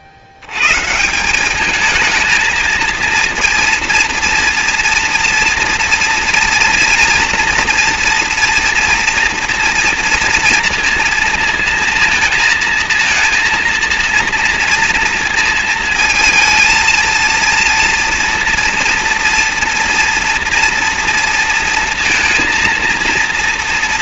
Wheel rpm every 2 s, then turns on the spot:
150, 220, 230, 230, 240, 230, 230, 230, 230, 230, 230, 230.
none